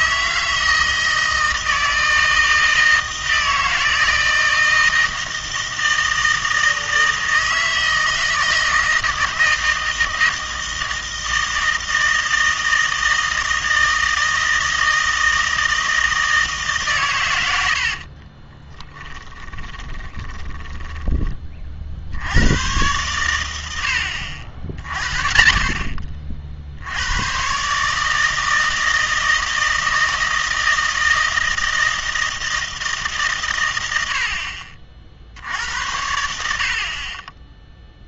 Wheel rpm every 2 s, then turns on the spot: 160, 160, 160, 160, 160, 160, 160, 160, 140, 20, 10, 110, 60, 70, 160, 160, 160, 40, 60.
18-22